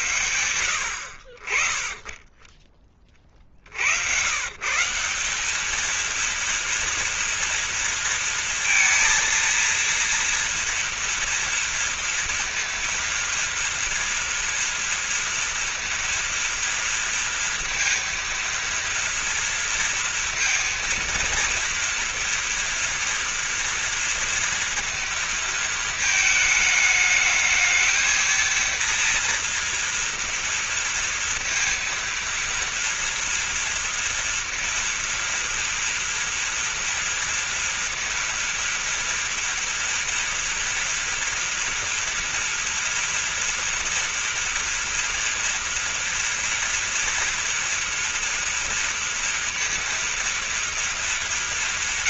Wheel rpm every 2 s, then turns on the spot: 80, 20, 150, 230, 230, 240, 240, 230, 230, 230, 230, 230, 230, 220, 230, 230, 230, 230, 230, 230, 230, 240, 230, 230, 230, 220.
none